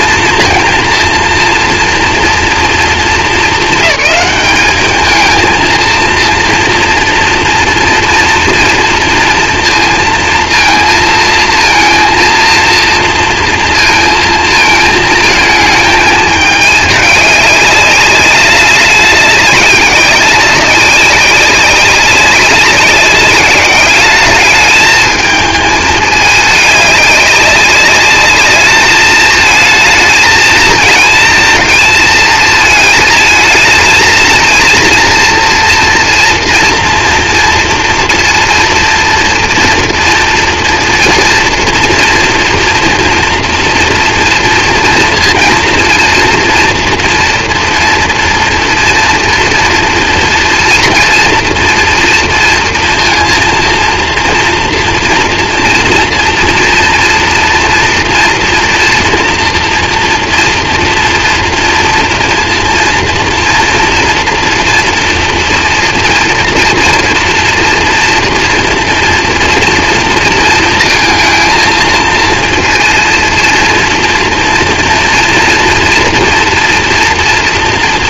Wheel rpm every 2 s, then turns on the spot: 230, 230, 210, 230, 230, 230, 230, 220, 210, 200, 190, 190, 210, 210, 210, 220, 220, 230, 230, 230, 230, 240, 230, 230, 230, 230, 230, 230, 230, 230, 240, 230, 230, 230, 230, 220, 230, 240, 240.
none